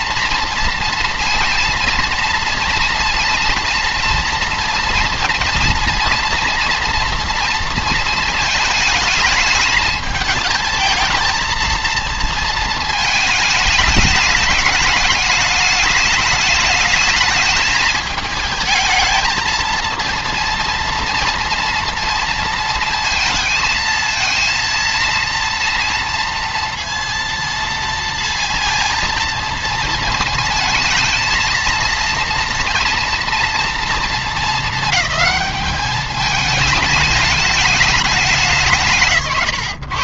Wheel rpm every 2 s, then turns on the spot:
230, 230, 230, 230, 220, 220, 230, 210, 210, 220, 230, 220, 230, 230, 230, 230, 230, 210, 220, 170.
none